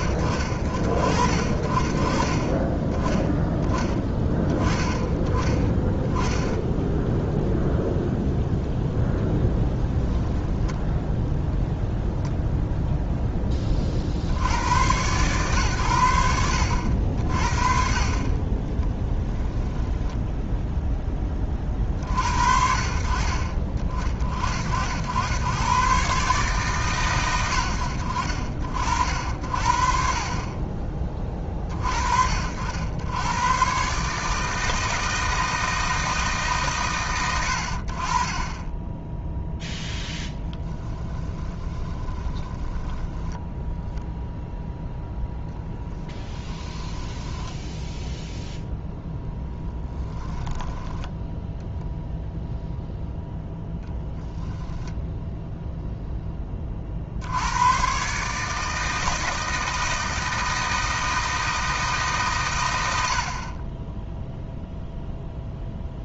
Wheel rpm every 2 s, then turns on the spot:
50, 10, 10, 0, 0, 0, 0, 100, 60, 10, 0, 50, 70, 130, 60, 20, 80, 160, 130, 10, 30, 10, 0, 10, 0, 10, 0, 0, 40, 160, 160, 90, 0.
18-20 40-44 46-48 50-52